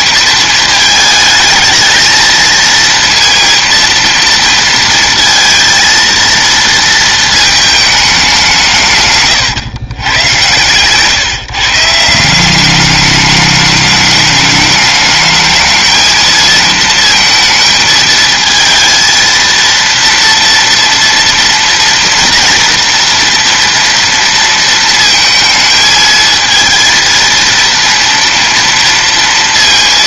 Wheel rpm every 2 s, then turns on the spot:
220, 230, 230, 230, 160, 110, 190, 210, 230, 220, 230, 230, 230, 220, 230.
none